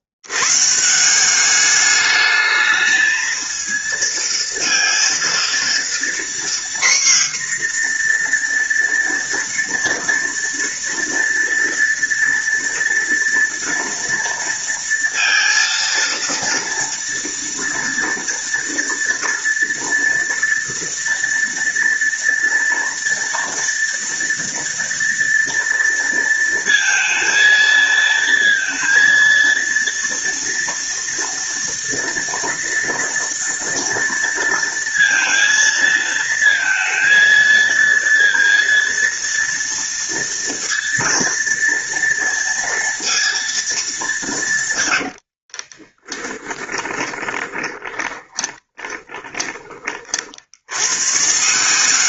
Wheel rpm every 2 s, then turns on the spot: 130, 220, 230, 250, 240, 230, 230, 230, 230, 230, 230, 230, 230, 230, 230, 230, 230, 230, 230, 230, 230, 230, 140, 20, 20, 100.
46-50